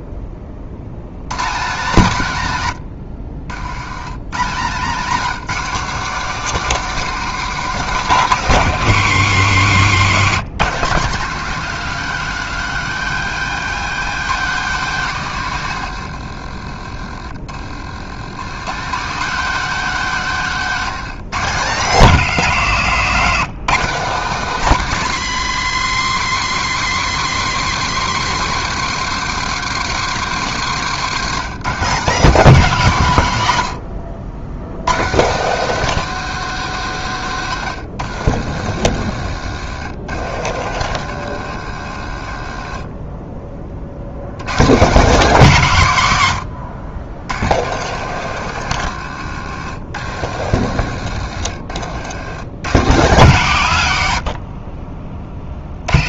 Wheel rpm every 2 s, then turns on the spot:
100, 120, 170, 230, 190, 180, 210, 210, 40, 180, 190, 160, 190, 180, 160, 140, 130, 130, 160, 80, 90, 30, 200, 80, 100, 90, 140, 30.
30-32 38-42 46-52 54-56